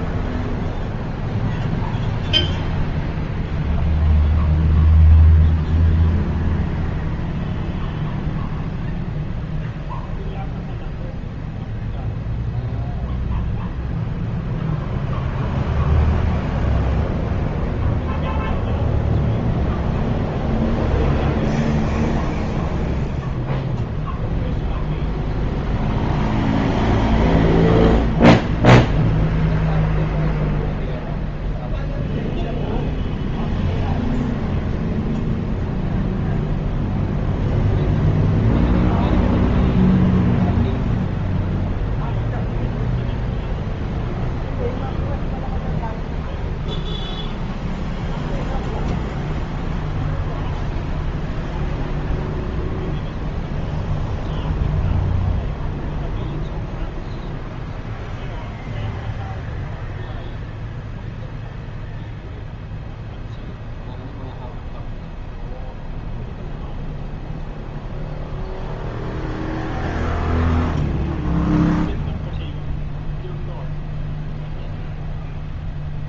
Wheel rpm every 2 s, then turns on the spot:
0, 0, 0, 0, 0, 0, 0, 0, 0, 0, 0, 0, 0, 0, 0, 0, 0, 0, 0, 0, 0, 0, 0, 0, 0, 0, 0, 0, 0, 0, 0, 0, 0, 0, 0, 0, 0, 0.
none